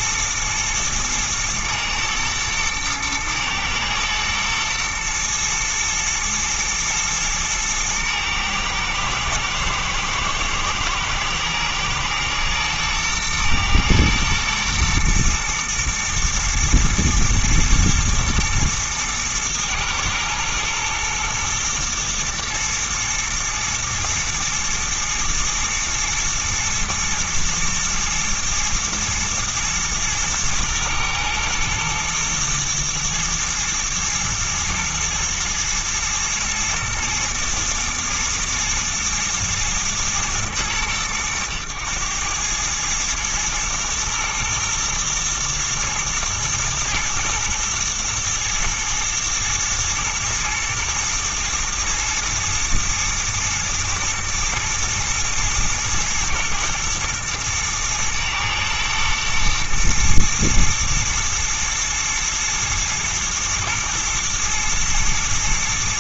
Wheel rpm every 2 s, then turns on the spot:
110, 110, 110, 110, 110, 110, 120, 110, 120, 110, 110, 120, 120, 120, 110, 110, 110, 120, 110, 110, 110, 110, 120, 120, 120, 120, 110, 110, 110, 110, 110, 120, 110.
none